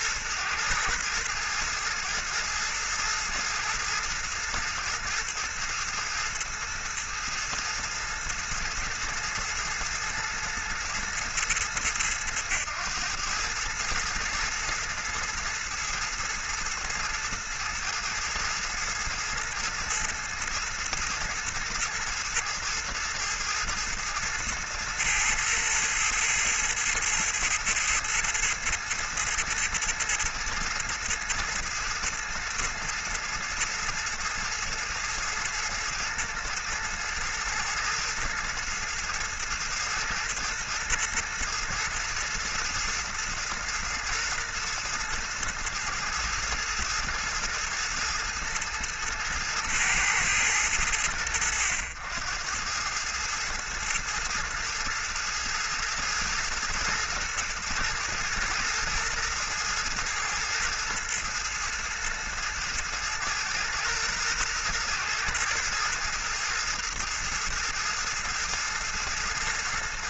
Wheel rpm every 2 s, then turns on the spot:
110, 110, 110, 110, 110, 110, 110, 110, 110, 110, 120, 110, 110, 110, 120, 110, 110, 110, 110, 110, 110, 120, 110, 110, 110, 100, 100, 110, 110, 110, 110, 110, 110, 110, 110.
none